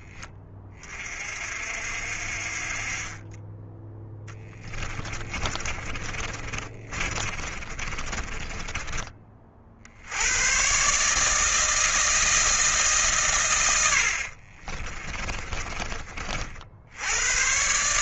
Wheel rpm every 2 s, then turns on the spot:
50, 20, 30, 40, 40, 160, 110, 30, 110.
4-8 14-16